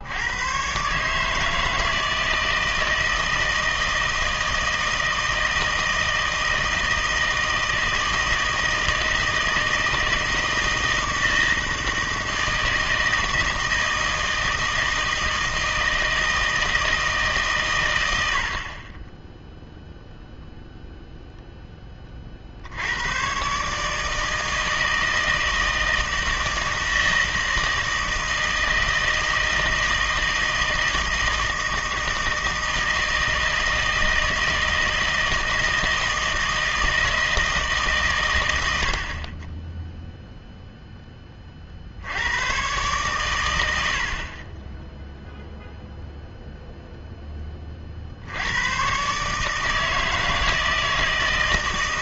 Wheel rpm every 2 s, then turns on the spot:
130, 160, 160, 160, 160, 160, 160, 160, 160, 40, 0, 70, 160, 160, 160, 160, 160, 160, 160, 90, 0, 110, 10, 0, 110, 160.
none